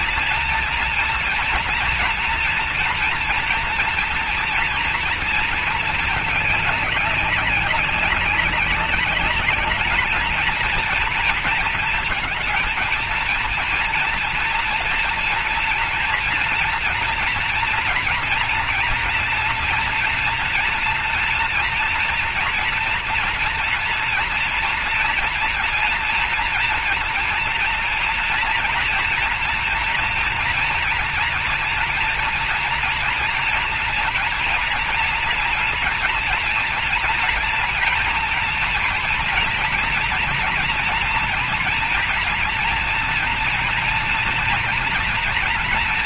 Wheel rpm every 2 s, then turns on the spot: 230, 230, 230, 210, 200, 220, 220, 230, 240, 240, 230, 240, 230, 240, 230, 240, 230, 230, 230, 230, 230, 240, 230.
none